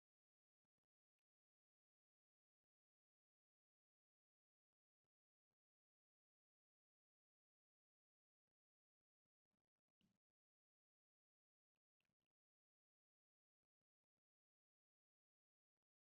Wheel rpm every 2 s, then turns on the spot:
0, 0, 0, 0, 0, 0, 0, 0.
none